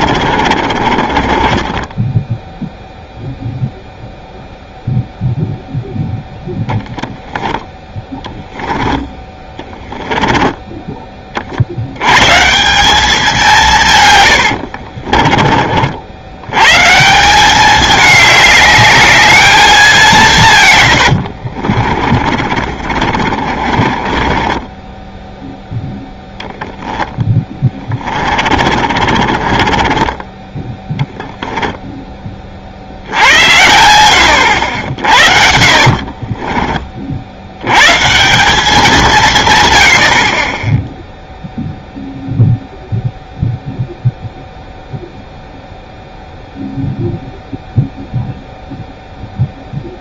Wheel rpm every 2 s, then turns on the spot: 40, 0, 0, 0, 10, 10, 170, 70, 130, 210, 140, 40, 20, 0, 30, 10, 50, 90, 30, 190, 20, 0, 0, 0, 0.
0-2 10-12 14-16 22-26 28-32